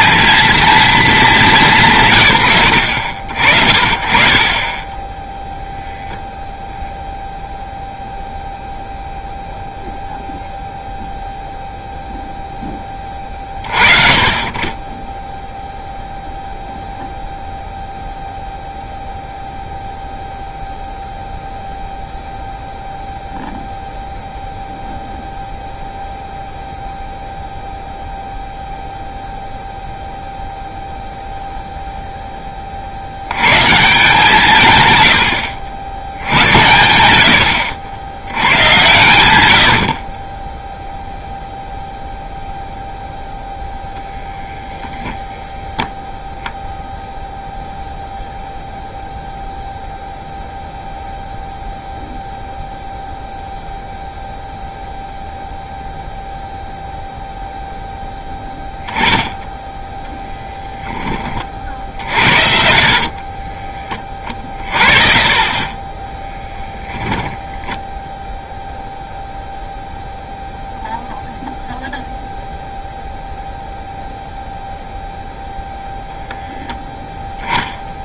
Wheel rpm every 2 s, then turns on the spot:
230, 90, 30, 0, 0, 0, 10, 20, 0, 0, 0, 0, 0, 0, 0, 0, 40, 140, 90, 100, 10, 0, 0, 0, 0, 0, 0, 0, 0, 10, 10, 60, 30, 10, 0, 0, 0, 0, 0.
62-64